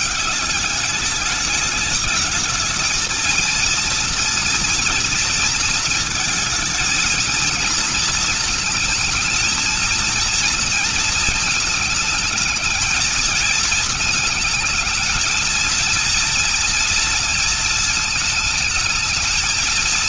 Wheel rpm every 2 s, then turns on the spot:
200, 220, 230, 220, 230, 230, 220, 220, 230, 220.
none